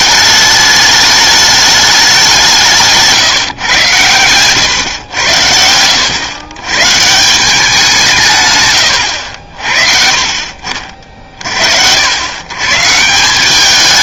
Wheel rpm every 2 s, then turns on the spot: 210, 170, 110, 110, 140, 50, 130.
none